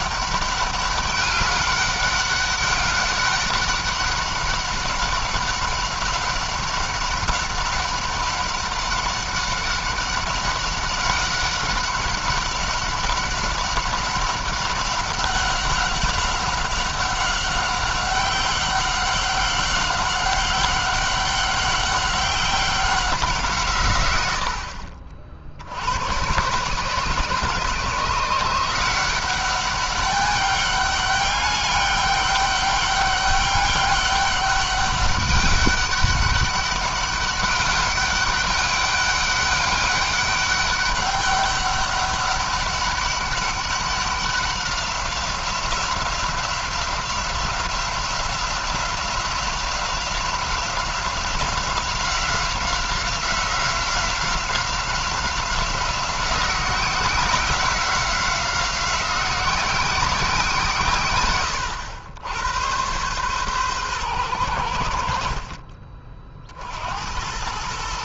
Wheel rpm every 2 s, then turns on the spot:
200, 200, 190, 200, 190, 190, 190, 190, 190, 190, 190, 190, 70, 140, 180, 200, 200, 200, 200, 200, 200, 200, 190, 180, 190, 180, 180, 180, 180, 180, 140, 110, 80, 80.
none